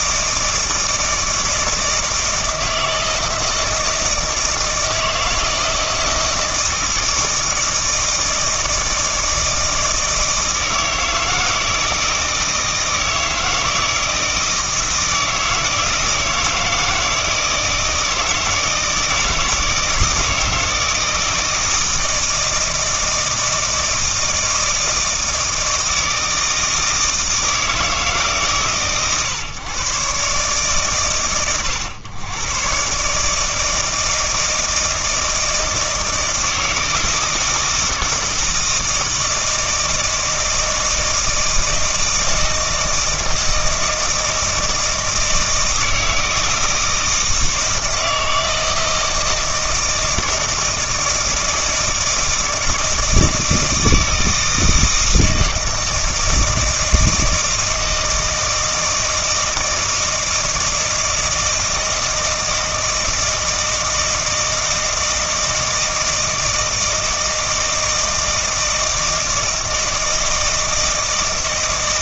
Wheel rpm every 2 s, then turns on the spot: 160, 160, 160, 160, 160, 160, 160, 160, 160, 160, 160, 160, 160, 160, 120, 100, 130, 160, 160, 160, 160, 160, 160, 160, 160, 160, 160, 160, 160, 160, 160, 160, 160, 160, 160, 160.
none